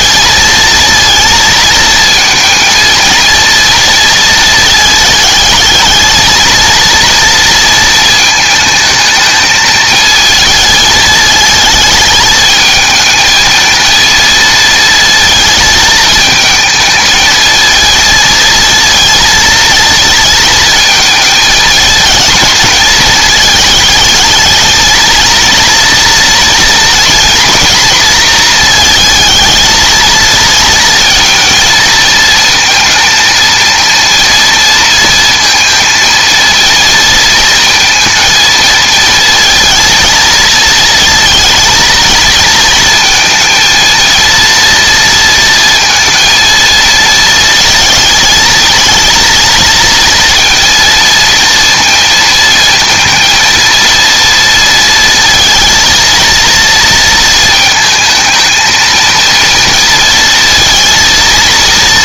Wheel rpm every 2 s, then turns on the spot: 230, 220, 220, 230, 220, 220, 220, 230, 220, 230, 220, 220, 220, 230, 220, 230, 230, 230, 230, 230, 220, 220, 230, 220, 220, 230, 230, 230, 230, 230, 230.
none